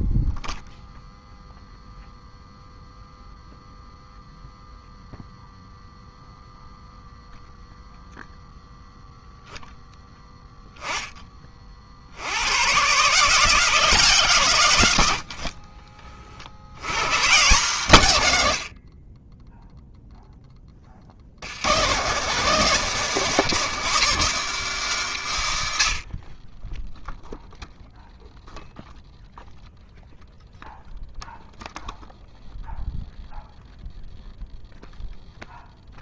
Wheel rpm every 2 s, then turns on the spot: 0, 0, 0, 0, 0, 10, 110, 120, 70, 50, 30, 160, 200, 10, 0, 0, 0, 0.
none